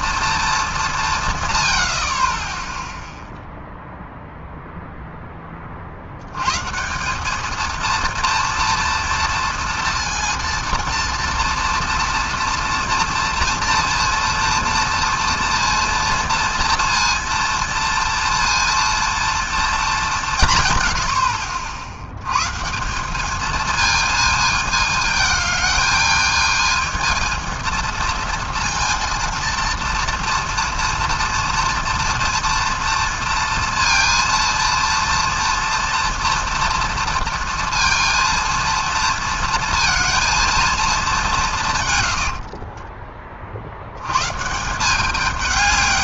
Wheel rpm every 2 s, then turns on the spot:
190, 0, 0, 140, 230, 230, 230, 240, 240, 230, 120, 160, 220, 220, 230, 230, 230, 230, 230, 230, 220, 40, 170.
42-44